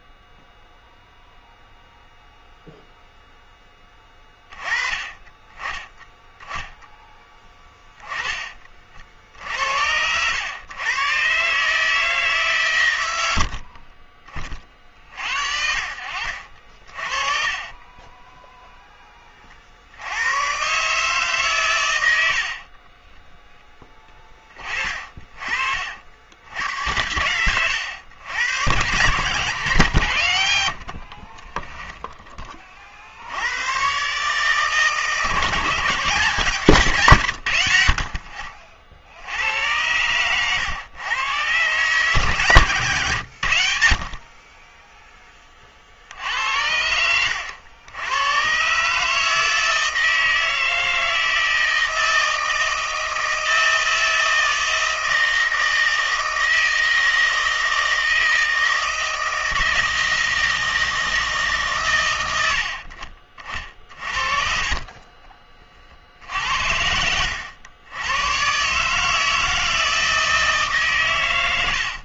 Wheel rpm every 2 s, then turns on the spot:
0, 0, 20, 10, 40, 120, 130, 40, 50, 0, 130, 40, 30, 90, 110, 70, 30, 150, 160, 60, 110, 130, 20, 90, 140, 160, 160, 160, 160, 160, 160, 70, 40, 60, 140, 150.
16-18 22-26 30-32 46-48 64-68